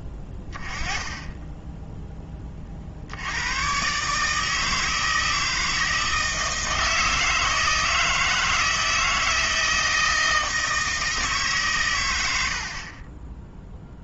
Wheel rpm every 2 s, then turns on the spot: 10, 40, 160, 160, 160, 160, 110.
none